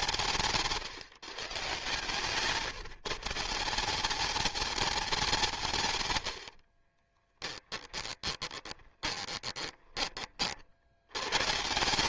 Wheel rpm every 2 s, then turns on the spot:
160, 150, 210, 50, 20, 60.
0-2 6-10